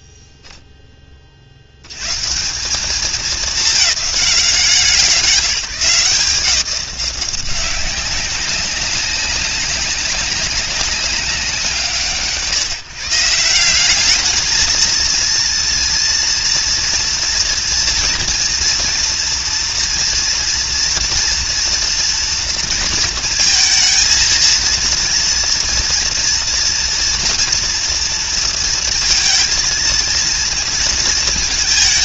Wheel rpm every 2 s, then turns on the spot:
0, 180, 180, 180, 190, 190, 140, 220, 230, 230, 240, 230, 230, 230, 230, 230.
none